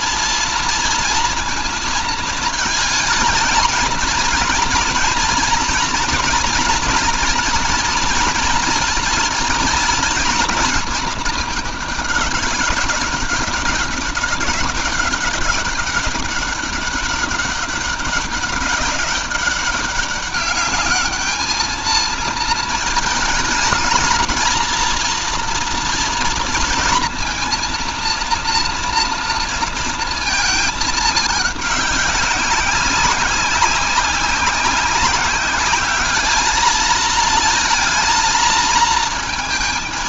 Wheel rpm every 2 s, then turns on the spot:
230, 220, 230, 230, 230, 230, 190, 200, 190, 190, 210, 220, 230, 230, 240, 210, 190, 190, 220, 230.
none